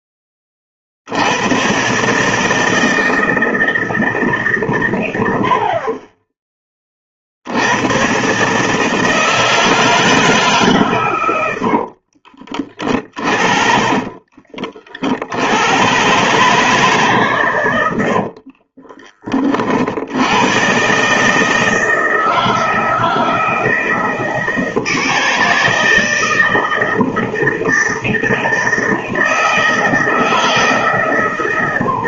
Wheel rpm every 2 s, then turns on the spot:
70, 160, 110, 50, 160, 120, 40, 60, 150, 30, 140, 160, 160, 160, 160, 150.
12-14